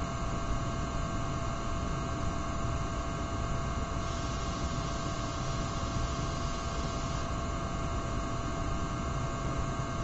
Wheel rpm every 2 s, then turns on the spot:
0, 0, 0, 0, 0.
none